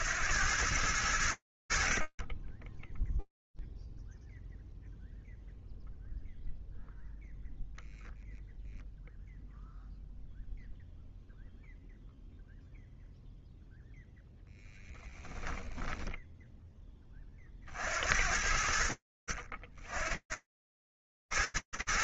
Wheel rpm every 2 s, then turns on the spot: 40, 0, 0, 0, 0, 0, 0, 10, 50, 70, 110.
14-16